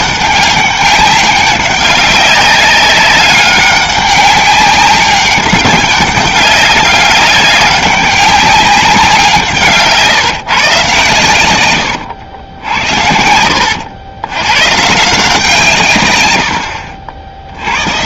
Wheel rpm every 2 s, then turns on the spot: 190, 200, 190, 200, 190, 140, 70, 130, 80.
none